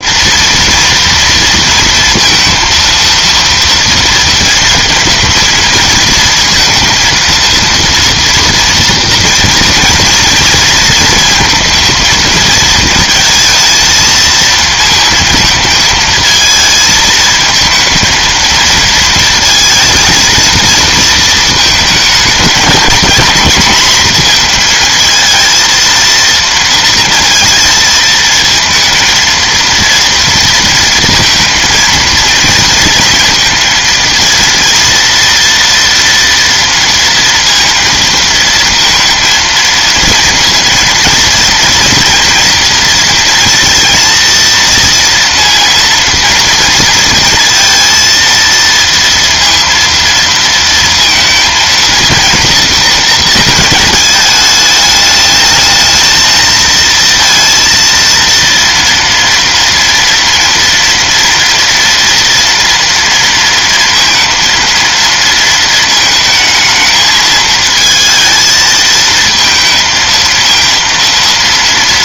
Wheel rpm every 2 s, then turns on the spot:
230, 230, 230, 230, 230, 230, 230, 230, 220, 230, 230, 220, 220, 230, 220, 230, 230, 230, 230, 230, 230, 240, 230, 230, 230, 230, 230, 210, 220, 230, 230, 230, 230, 220, 220, 230.
none